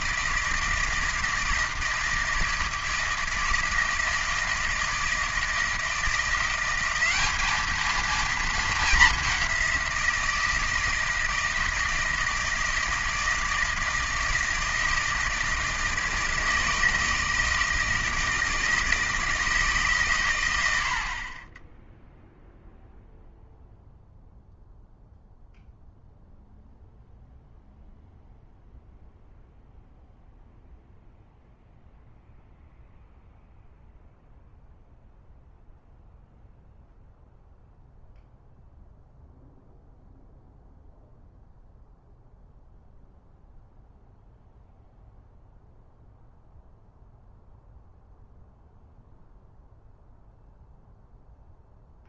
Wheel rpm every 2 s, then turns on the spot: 160, 160, 160, 190, 220, 160, 160, 160, 160, 160, 90, 0, 0, 0, 0, 0, 0, 0, 0, 0, 0, 0, 0, 0, 0, 0.
none